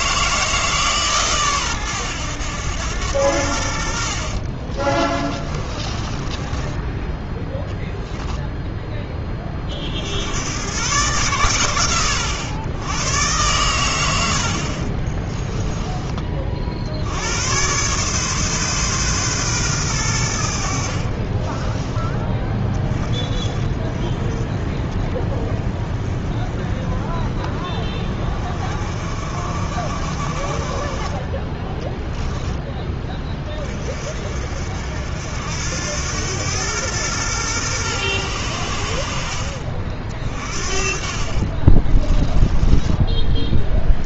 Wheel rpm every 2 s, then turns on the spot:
160, 100, 30, 10, 10, 110, 90, 50, 50, 140, 70, 20, 20, 20, 40, 30, 10, 60, 110, 80, 50, 10.
4-8 14-16 40-44